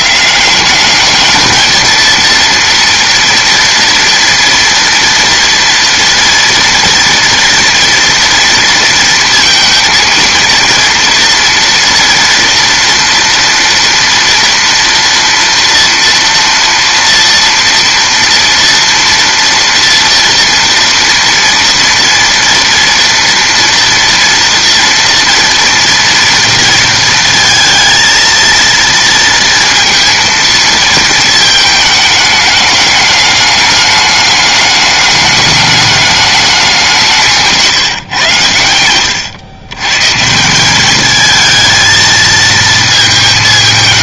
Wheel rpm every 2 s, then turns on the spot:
200, 230, 230, 230, 230, 230, 230, 230, 230, 230, 230, 230, 230, 230, 230, 230, 210, 210, 190, 100, 190, 230.
none